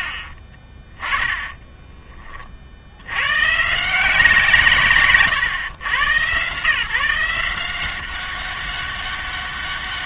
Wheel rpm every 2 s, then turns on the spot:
30, 60, 160, 140, 200.
0-2